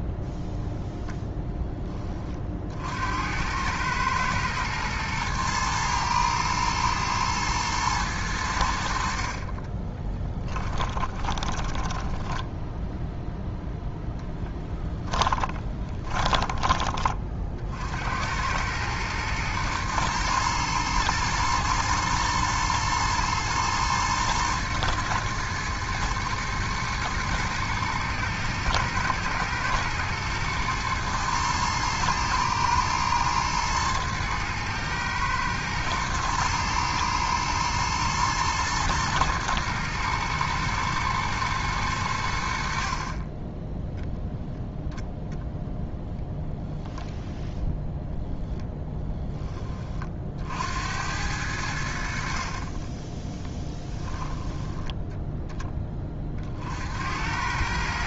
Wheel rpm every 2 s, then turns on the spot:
0, 60, 110, 110, 70, 20, 0, 10, 20, 100, 110, 110, 120, 110, 110, 110, 120, 110, 110, 120, 120, 50, 0, 0, 0, 80, 30, 10, 60.
10-12 14-16 52-54